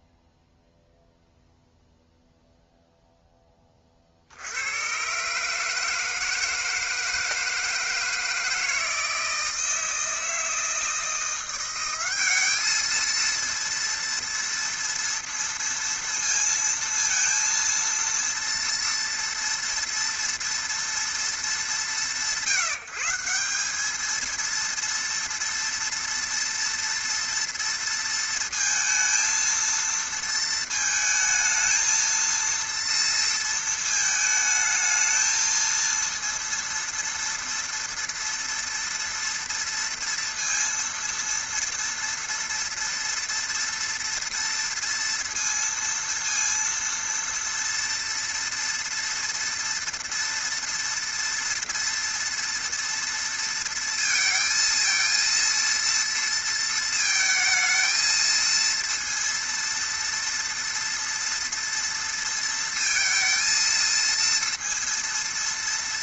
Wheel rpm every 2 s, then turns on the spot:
0, 0, 80, 160, 160, 160, 200, 230, 230, 230, 230, 170, 230, 230, 230, 220, 230, 220, 230, 230, 230, 230, 230, 230, 230, 230, 230, 230, 230, 230, 230, 230, 230.
none